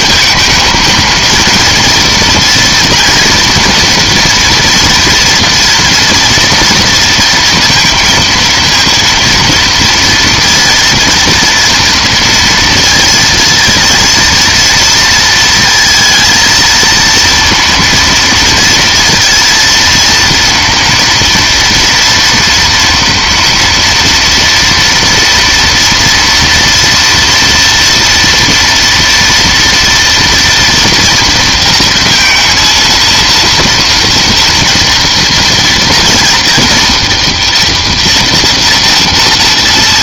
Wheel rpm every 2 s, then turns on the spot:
220, 230, 230, 230, 230, 230, 230, 230, 230, 230, 240, 240, 230, 230, 230, 230, 230, 240, 240, 240.
none